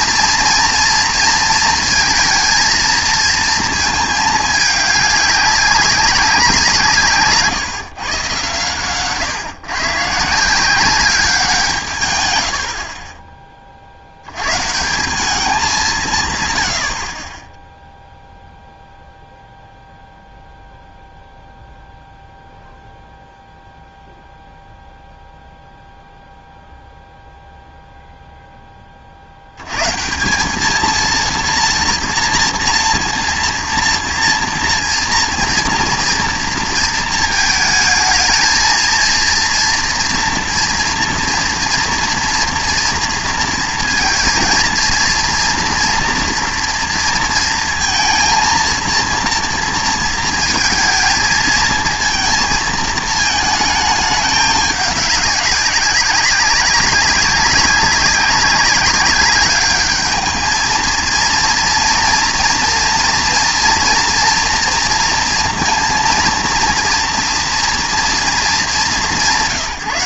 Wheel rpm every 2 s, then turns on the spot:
230, 230, 210, 180, 130, 190, 70, 120, 100, 0, 0, 0, 0, 0, 20, 210, 230, 230, 230, 230, 230, 230, 230, 230, 230, 220, 220, 200, 190, 190, 220, 230, 230, 230, 210.
none